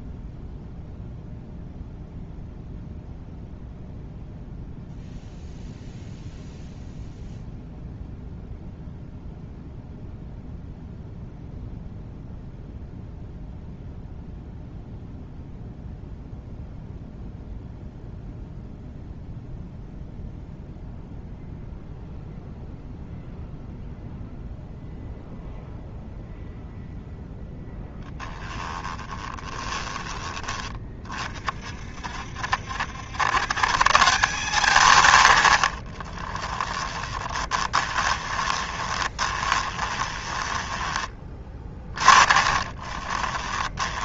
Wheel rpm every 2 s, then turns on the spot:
0, 0, 0, 0, 0, 0, 0, 0, 0, 0, 0, 0, 0, 0, 10, 30, 100, 130, 20, 20, 10, 20.
28-30 36-44